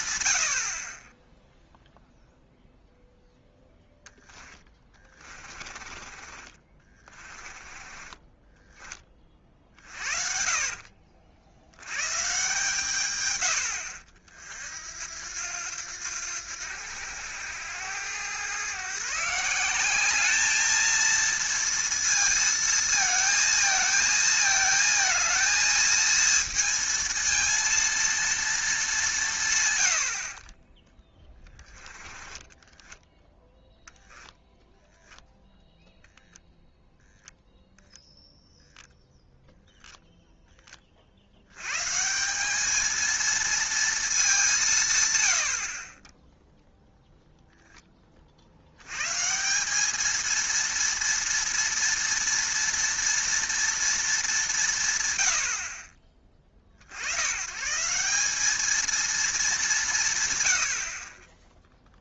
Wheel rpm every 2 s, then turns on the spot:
50, 0, 20, 20, 20, 50, 130, 70, 90, 130, 220, 230, 220, 230, 210, 30, 10, 0, 0, 0, 20, 220, 150, 0, 90, 230, 230, 160, 50, 220, 70.
4-8 10-12 30-34